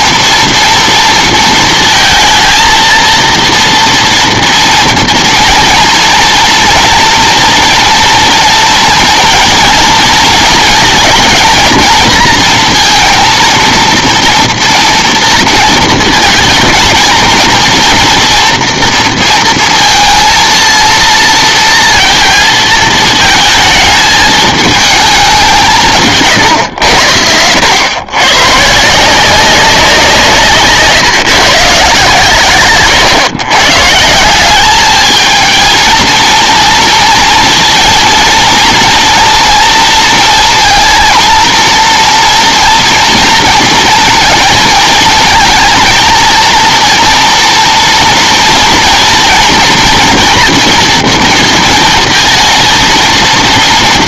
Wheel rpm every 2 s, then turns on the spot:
230, 230, 230, 230, 230, 230, 230, 230, 230, 230, 230, 220, 220, 100, 150, 150, 120, 210, 230, 230, 230, 230, 230, 230, 230, 230, 230.
32-34